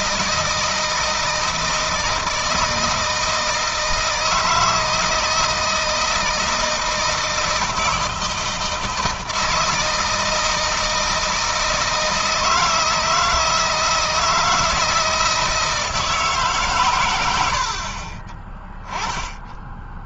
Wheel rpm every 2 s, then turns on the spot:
160, 160, 160, 160, 160, 160, 160, 160, 130, 10.
none